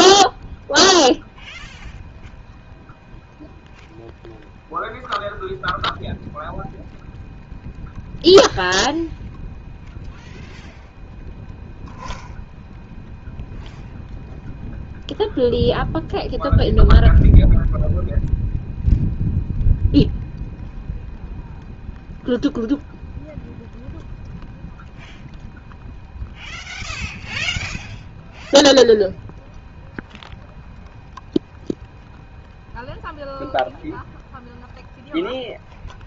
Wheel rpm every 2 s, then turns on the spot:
0, 0, 0, 0, 0, 0, 0, 0, 0, 0, 0, 0, 0, 0, 0, 0, 0, 0.
none